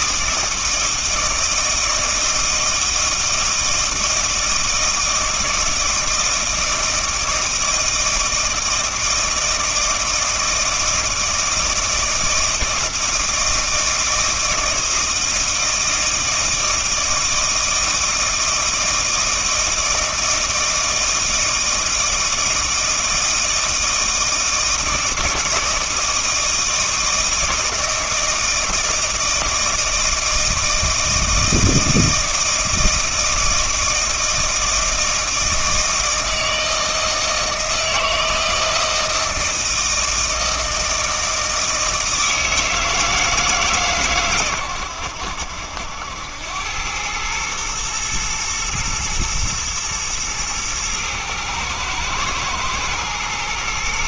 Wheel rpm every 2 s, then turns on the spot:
160, 160, 160, 160, 160, 160, 160, 160, 160, 160, 160, 160, 160, 160, 160, 160, 160, 160, 160, 160, 160, 160, 100, 100, 120, 110, 110.
none